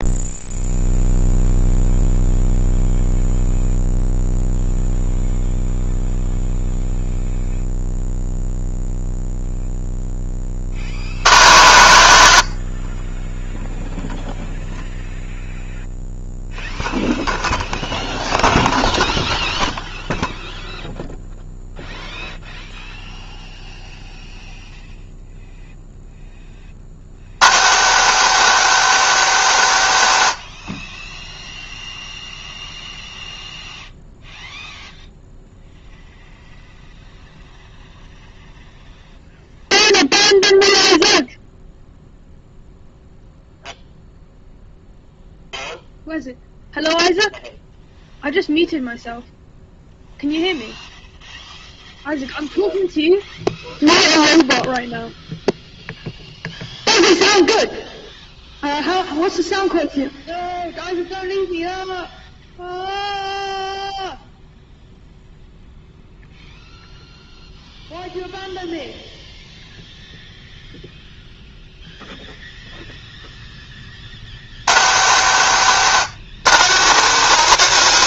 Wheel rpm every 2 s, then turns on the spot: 0, 0, 0, 0, 0, 40, 70, 0, 0, 0, 0, 0, 0, 30, 200, 60, 0, 0, 0, 0, 0, 0, 0, 0, 0, 0, 0, 0, 0, 0, 0, 0, 0, 0, 0, 0, 0, 110, 190.
none